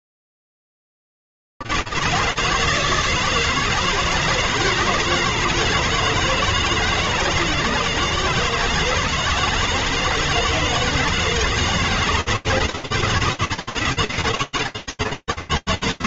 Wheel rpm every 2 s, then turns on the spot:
40, 100, 160, 160, 160, 160, 160, 160.
none